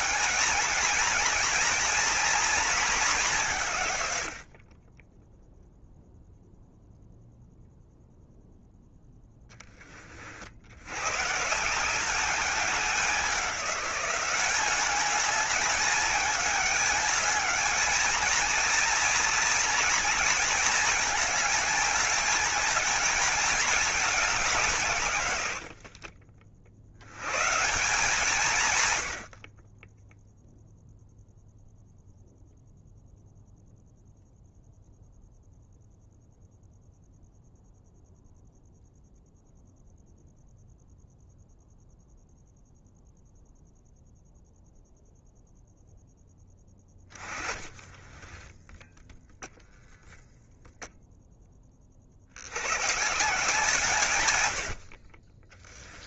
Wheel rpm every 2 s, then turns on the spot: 220, 210, 20, 0, 0, 110, 190, 200, 210, 230, 230, 220, 150, 80, 110, 0, 0, 0, 0, 0, 0, 0, 0, 20, 0, 0, 130, 60.
46-48